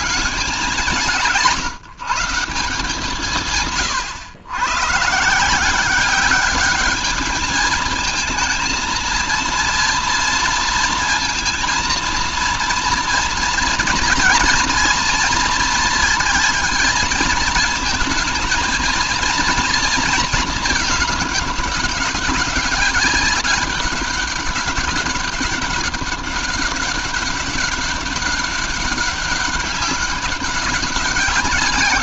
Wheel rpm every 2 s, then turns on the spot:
170, 160, 120, 200, 220, 230, 230, 240, 220, 220, 210, 200, 200, 200, 200, 190.
none